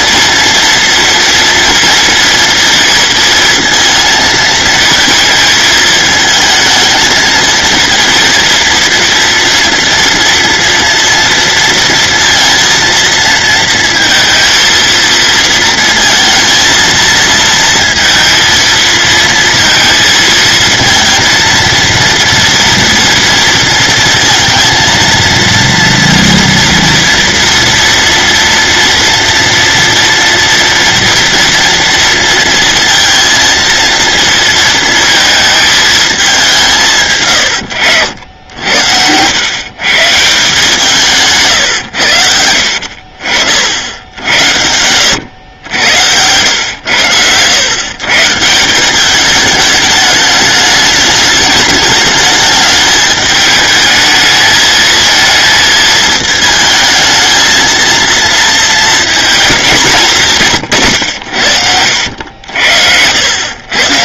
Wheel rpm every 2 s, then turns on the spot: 230, 230, 220, 220, 230, 230, 230, 230, 230, 230, 230, 230, 230, 230, 230, 230, 230, 230, 160, 80, 160, 60, 100, 100, 180, 210, 210, 220, 220, 230, 130, 80.
none